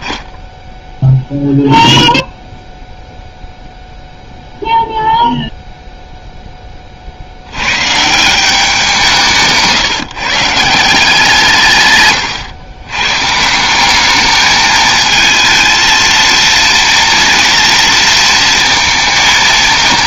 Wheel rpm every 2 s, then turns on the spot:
0, 0, 0, 40, 180, 160, 120, 220, 230, 220.
none